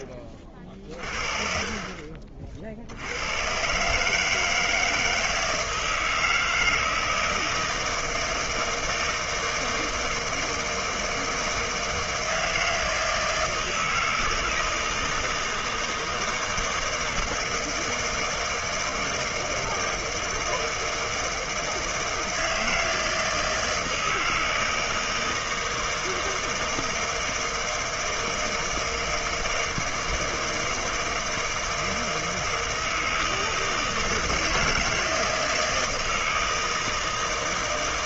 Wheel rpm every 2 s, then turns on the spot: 40, 70, 160, 160, 160, 160, 160, 160, 160, 160, 160, 160, 160, 160, 160, 160, 160, 160, 160.
0-2